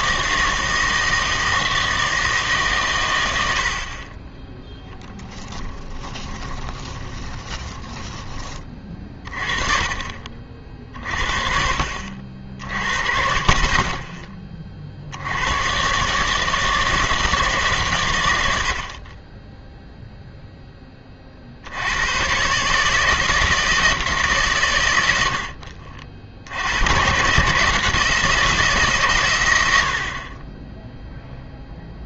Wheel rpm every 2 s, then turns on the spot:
160, 150, 20, 30, 20, 50, 60, 30, 160, 70, 10, 140, 130, 80, 160, 20.
6-8